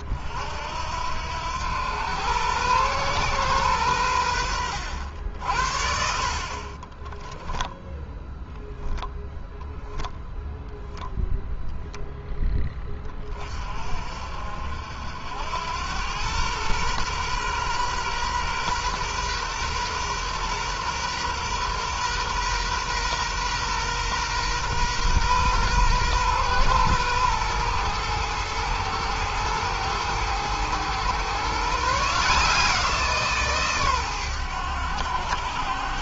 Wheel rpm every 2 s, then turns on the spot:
70, 120, 80, 20, 10, 0, 20, 70, 120, 120, 120, 120, 120, 120, 110, 120, 160, 100.
6-8